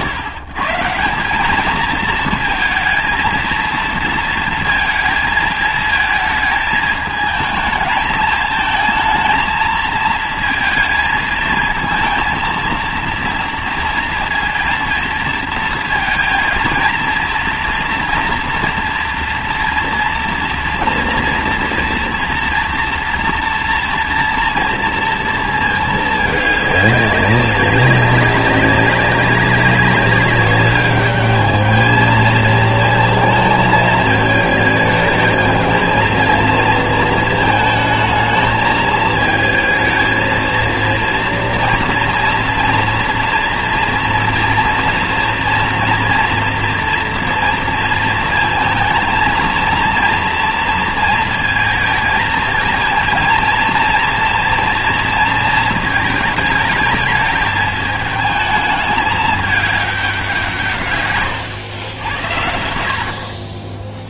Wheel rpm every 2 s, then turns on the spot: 150, 220, 230, 220, 220, 220, 230, 230, 230, 240, 230, 240, 230, 200, 200, 200, 230, 220, 230, 220, 230, 230, 230, 230, 230, 230, 230, 230, 220, 220, 150, 60.
none